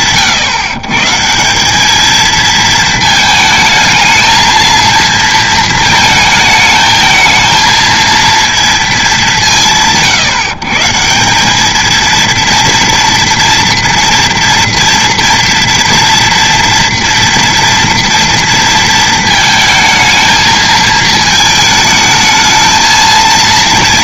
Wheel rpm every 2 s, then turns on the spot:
140, 220, 230, 220, 160, 160, 230, 240, 230, 230, 220, 230.
none